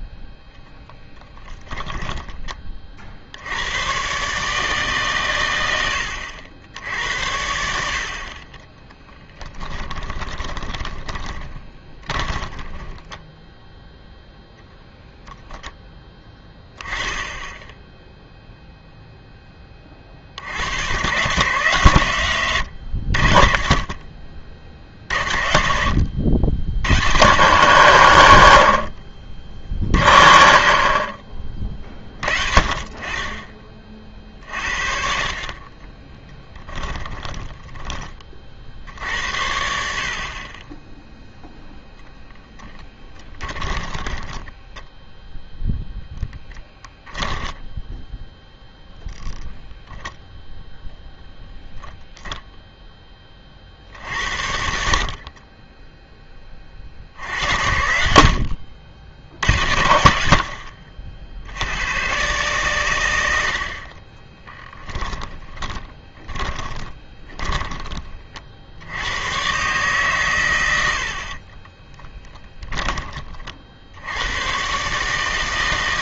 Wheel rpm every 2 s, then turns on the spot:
10, 30, 150, 80, 20, 20, 20, 0, 10, 0, 90, 100, 60, 90, 90, 50, 40, 50, 10, 60, 20, 10, 10, 10, 0, 0, 0, 80, 30, 70, 70, 120, 20, 20, 60, 110, 10, 120.
8-14 36-38 42-46 64-68 72-74